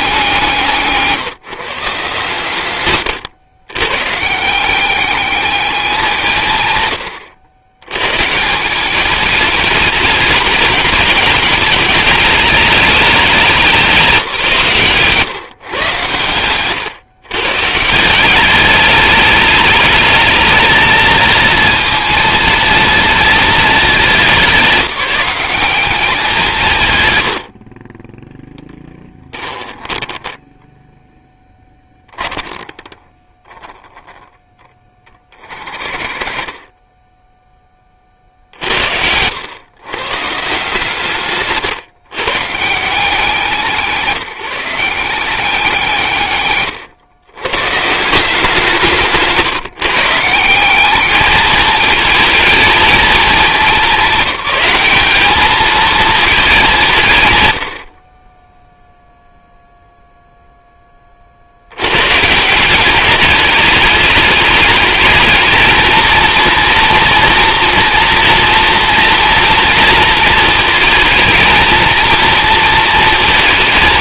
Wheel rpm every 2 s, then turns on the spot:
150, 160, 190, 120, 190, 200, 210, 140, 130, 210, 220, 230, 200, 130, 10, 10, 10, 20, 20, 80, 150, 160, 180, 120, 170, 200, 220, 210, 170, 0, 20, 190, 220, 240, 230, 220, 230.
none